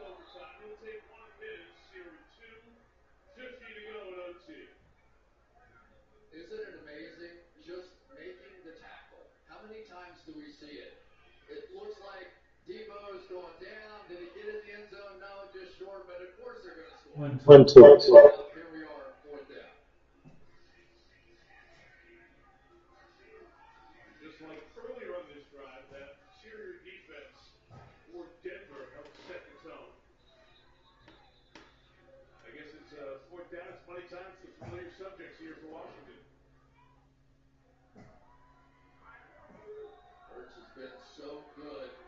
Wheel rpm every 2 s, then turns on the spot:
0, 0, 0, 0, 0, 0, 0, 0, 0, 0, 0, 0, 0, 0, 0, 0, 0, 0, 0, 0, 0.
none